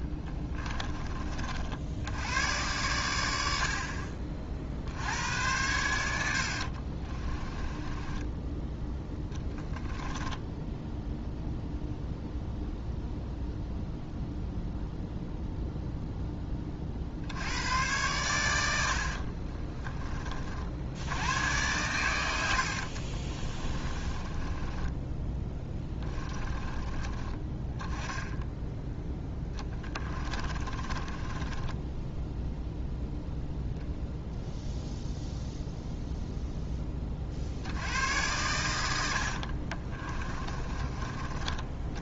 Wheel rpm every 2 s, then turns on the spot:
20, 110, 60, 40, 10, 10, 0, 0, 50, 70, 80, 60, 20, 20, 0, 20, 0, 0, 20, 90, 30.
6-8 10-12 18-20 22-26 30-32